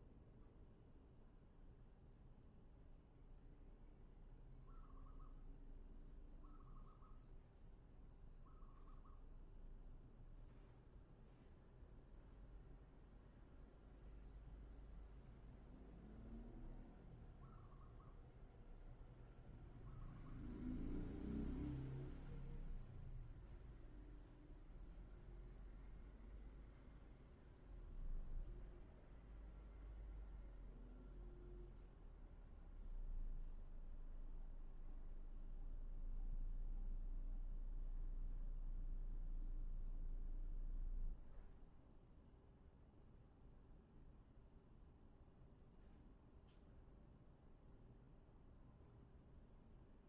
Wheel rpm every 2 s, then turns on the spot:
0, 0, 0, 0, 0, 0, 0, 0, 0, 0, 0, 0, 0, 0, 0, 0, 0, 0, 0, 0, 0, 0, 0, 0, 0.
none